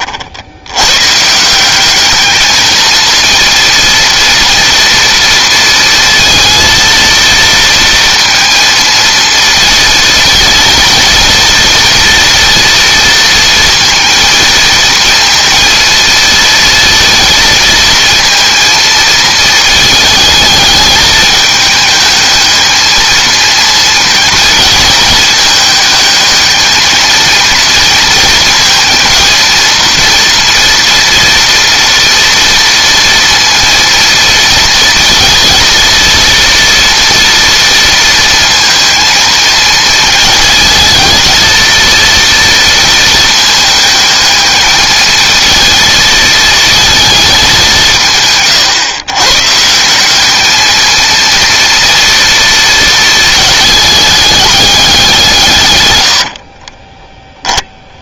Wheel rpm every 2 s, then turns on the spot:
110, 220, 230, 230, 230, 230, 230, 230, 230, 230, 220, 220, 220, 220, 230, 230, 230, 230, 230, 230, 220, 230, 220, 220, 130, 220, 230, 200, 20.
56-58